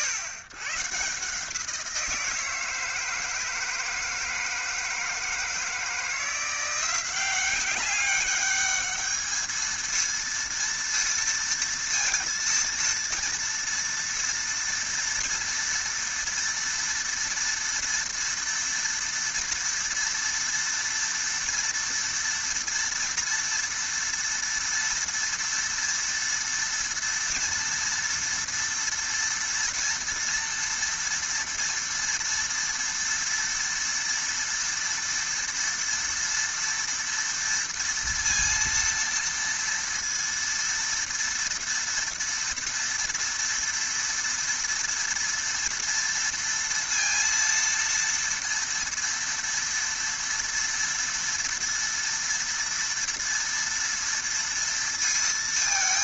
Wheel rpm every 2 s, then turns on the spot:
130, 160, 160, 180, 210, 230, 230, 230, 230, 230, 230, 230, 230, 230, 240, 240, 230, 230, 230, 230, 230, 230, 230, 230, 230, 230, 230, 230.
none